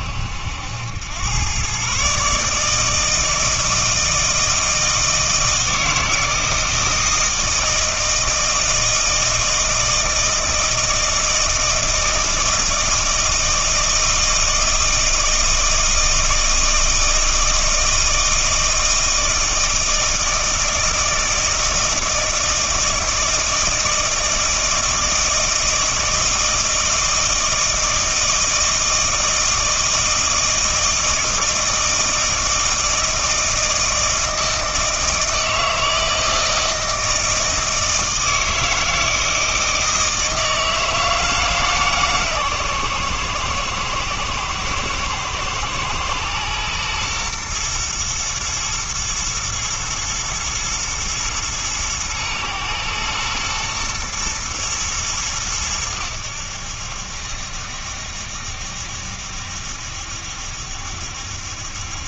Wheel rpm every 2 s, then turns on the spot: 80, 150, 160, 160, 160, 160, 160, 160, 160, 160, 160, 160, 160, 160, 160, 160, 160, 160, 160, 160, 160, 130, 110, 120, 110, 120, 110, 110, 80, 70, 70.
none